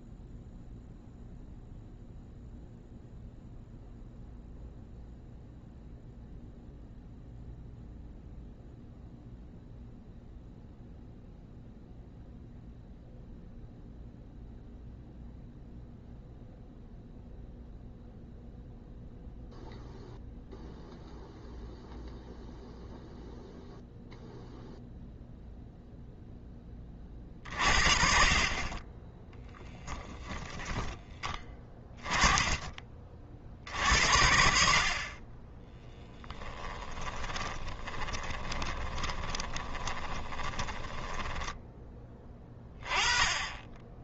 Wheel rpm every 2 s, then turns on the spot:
0, 0, 0, 0, 0, 0, 0, 0, 0, 0, 0, 0, 0, 20, 20, 10, 30, 50, 10, 20, 10, 20.
36-42